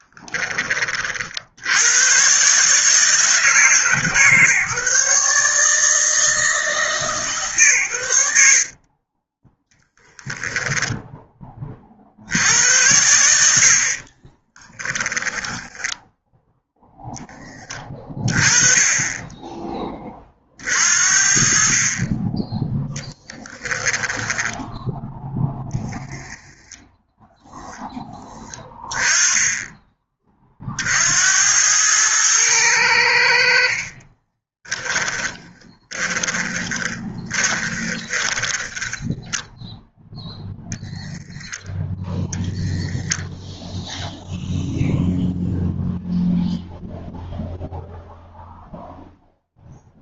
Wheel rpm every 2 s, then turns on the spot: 50, 150, 150, 150, 30, 10, 90, 20, 10, 20, 50, 10, 0, 0, 20, 60, 90, 10, 20, 10, 0, 0, 0, 0, 0.
8-10 14-16 22-24 34-40